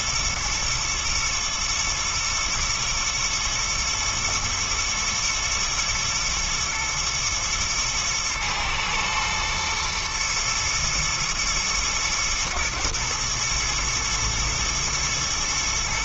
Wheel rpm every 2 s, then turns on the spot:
120, 110, 120, 110, 110, 120, 110, 110.
none